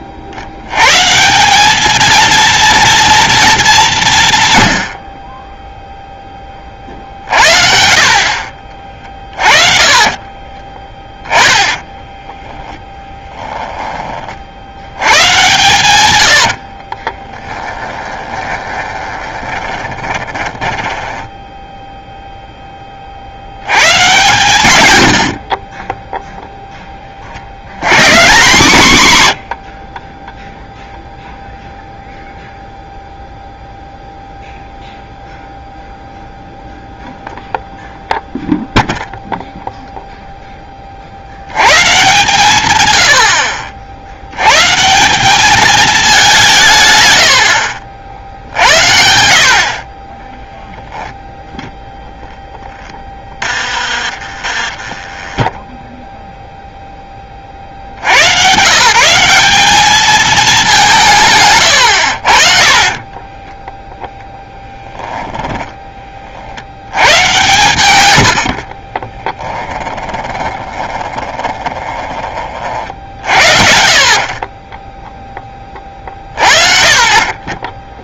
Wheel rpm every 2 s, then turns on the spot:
120, 230, 100, 40, 40, 20, 10, 70, 50, 20, 20, 10, 120, 10, 150, 0, 0, 0, 0, 0, 40, 110, 160, 150, 70, 0, 10, 30, 0, 140, 200, 40, 10, 70, 50, 20, 50, 20, 50.
8-14 16-22 52-56 62-64 70-72